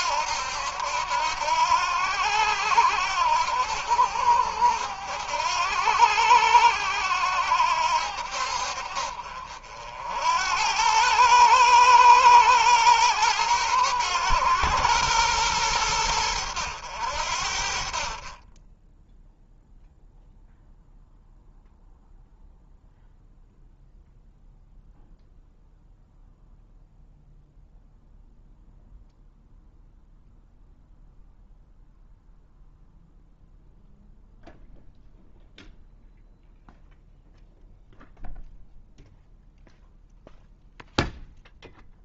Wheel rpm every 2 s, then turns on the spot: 80, 80, 80, 70, 80, 120, 110, 90, 30, 0, 0, 0, 0, 0, 0, 0, 0, 0, 0, 0, 0.
none